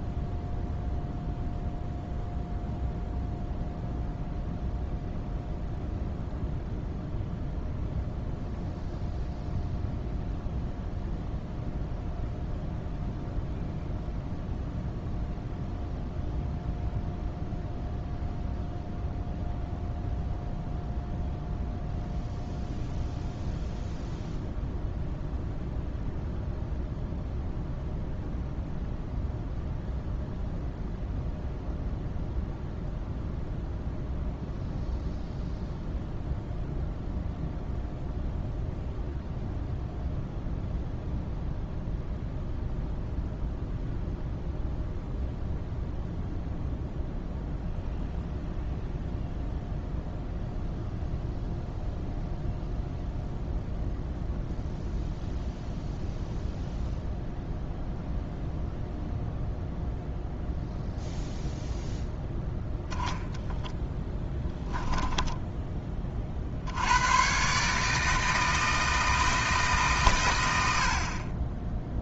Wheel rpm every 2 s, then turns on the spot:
0, 0, 0, 0, 0, 0, 0, 0, 0, 0, 0, 0, 0, 0, 0, 0, 0, 0, 0, 0, 0, 0, 0, 0, 0, 0, 0, 0, 0, 0, 0, 0, 10, 80, 160, 70.
none